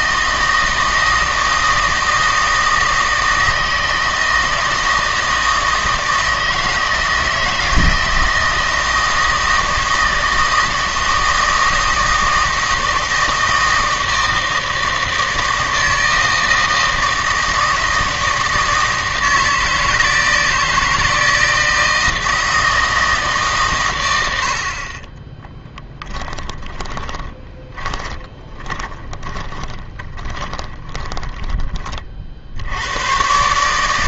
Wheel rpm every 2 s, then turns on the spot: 160, 160, 160, 160, 160, 160, 160, 160, 160, 160, 160, 160, 40, 20, 20, 20, 90.
26-32